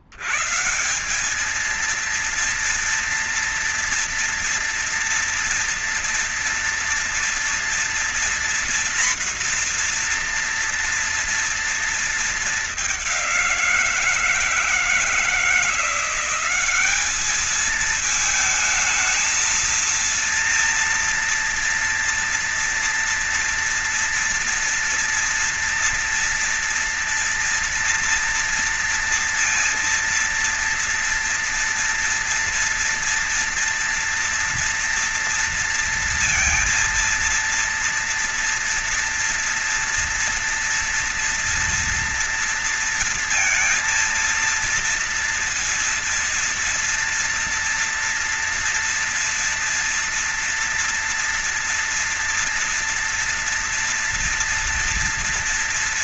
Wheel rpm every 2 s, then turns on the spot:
50, 230, 230, 230, 240, 240, 220, 170, 180, 220, 230, 230, 230, 230, 230, 230, 230, 230, 230, 230, 230, 230, 230, 230, 230, 230, 240, 230.
none